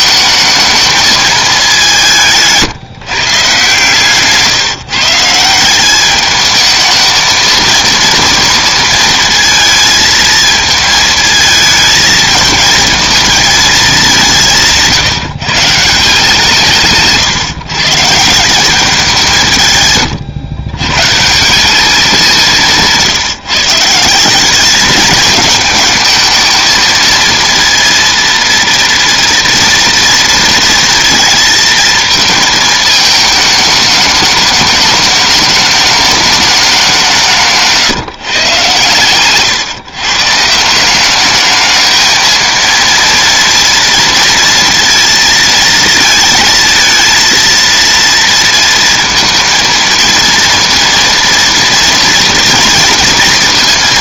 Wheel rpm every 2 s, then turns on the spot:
220, 150, 150, 220, 230, 220, 220, 170, 160, 180, 120, 170, 200, 220, 230, 230, 220, 210, 200, 130, 160, 230, 230, 220, 230, 230, 230.
none